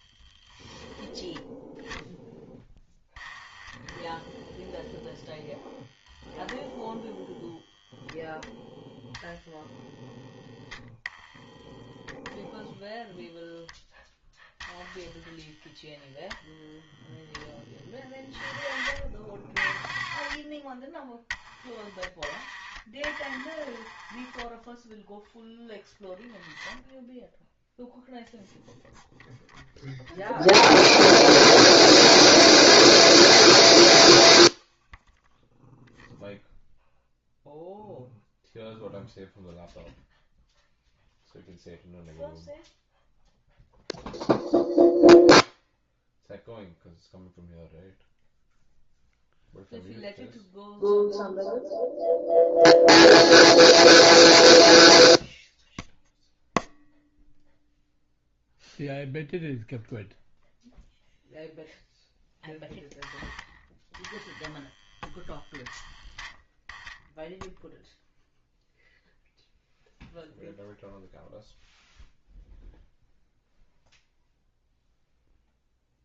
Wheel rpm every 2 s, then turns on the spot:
0, 10, 0, 0, 0, 0, 0, 0, 0, 30, 10, 20, 0, 0, 0, 0, 0, 0, 0, 0, 0, 0, 0, 0, 0, 0, 0, 0, 0, 0, 0, 10, 10, 0, 0, 0, 0, 0.
none